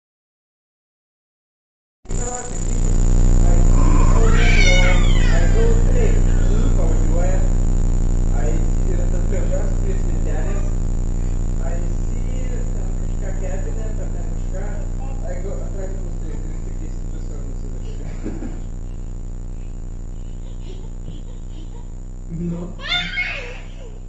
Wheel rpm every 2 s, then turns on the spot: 0, 10, 20, 0, 0, 0, 0, 0, 0, 0, 0, 0.
none